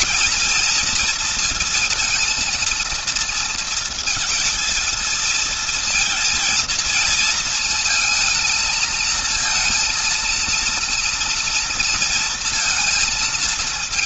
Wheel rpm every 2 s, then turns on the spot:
230, 230, 230, 220, 220, 230, 230.
none